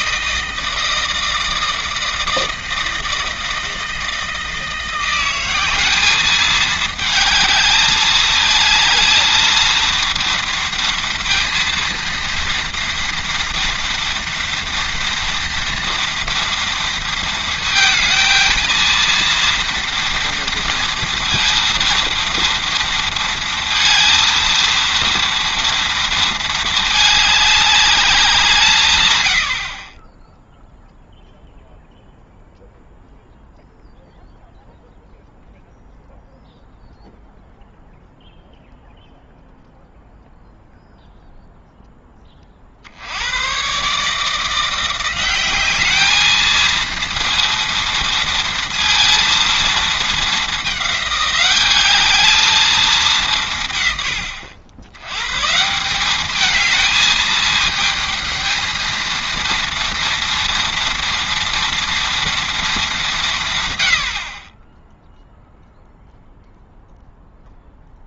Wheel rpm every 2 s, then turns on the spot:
160, 160, 170, 220, 220, 230, 230, 230, 230, 230, 230, 230, 230, 220, 150, 0, 0, 0, 0, 0, 0, 60, 170, 230, 230, 200, 210, 90, 220, 220, 230, 220, 10, 0.
none